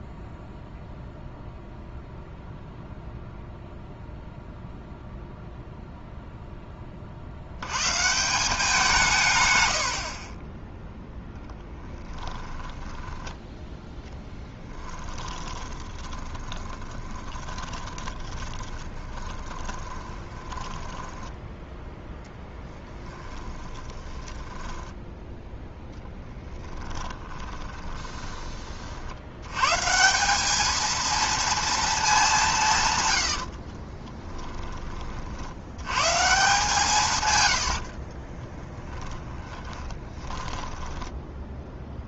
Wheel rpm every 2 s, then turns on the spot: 0, 0, 0, 20, 170, 10, 20, 20, 20, 20, 10, 10, 10, 10, 50, 220, 140, 20, 150, 20, 10.
12-28 38-42